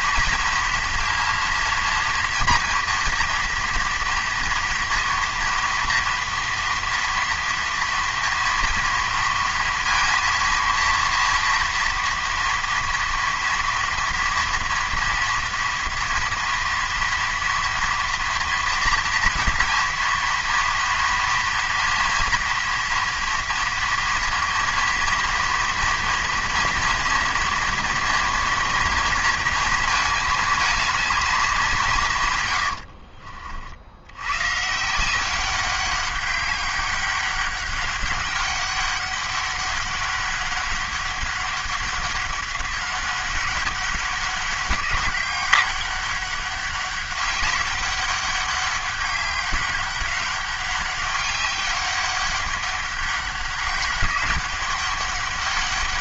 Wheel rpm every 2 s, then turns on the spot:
230, 230, 230, 230, 230, 230, 230, 230, 230, 230, 230, 230, 230, 230, 230, 220, 100, 140, 200, 200, 200, 200, 190, 200, 200, 200, 200, 200.
32-34